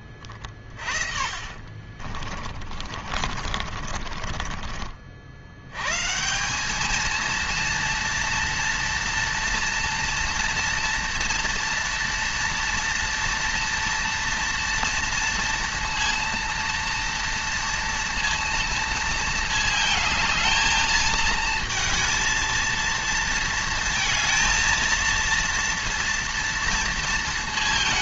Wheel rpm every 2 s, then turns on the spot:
40, 40, 70, 220, 230, 230, 230, 230, 230, 220, 220, 230, 230, 230.
0-4